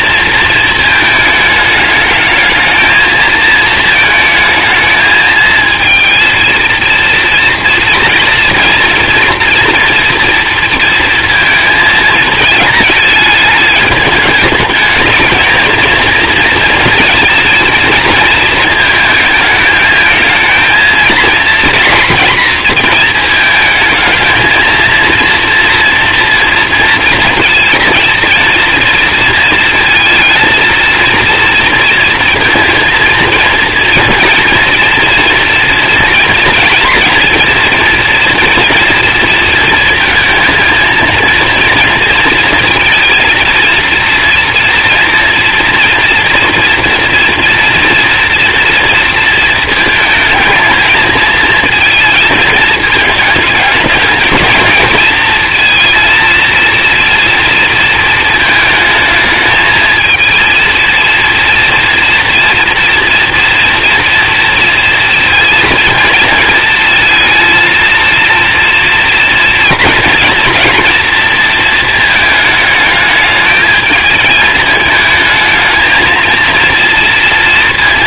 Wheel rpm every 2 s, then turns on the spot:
220, 220, 220, 230, 240, 230, 210, 220, 230, 220, 230, 220, 230, 230, 230, 230, 230, 230, 230, 230, 230, 230, 230, 230, 230, 220, 220, 230, 230, 220, 230, 240, 230, 230, 230, 240, 220, 220, 230.
none